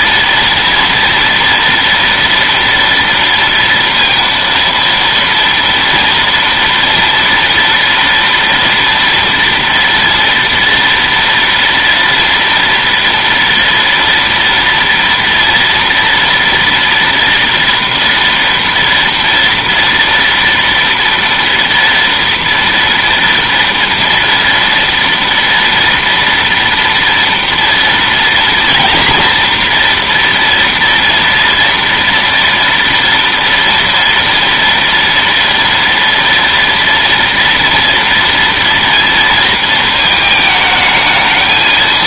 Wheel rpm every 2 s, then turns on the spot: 230, 230, 230, 230, 230, 240, 230, 230, 240, 230, 230, 230, 230, 230, 240, 240, 230, 230, 230, 230, 220.
none